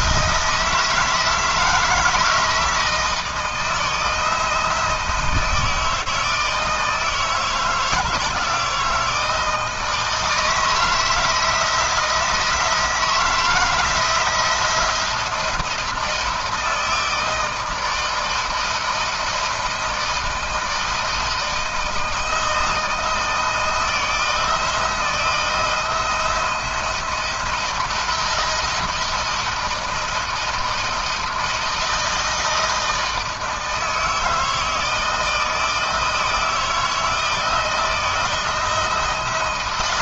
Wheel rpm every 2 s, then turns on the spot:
160, 160, 160, 160, 160, 160, 160, 170, 160, 160, 160, 160, 160, 170, 160, 160, 160, 160, 160, 160.
none